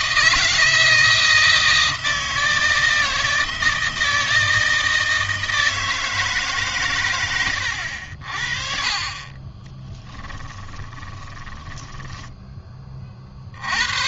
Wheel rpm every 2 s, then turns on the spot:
160, 160, 160, 130, 30, 10, 20.
10-12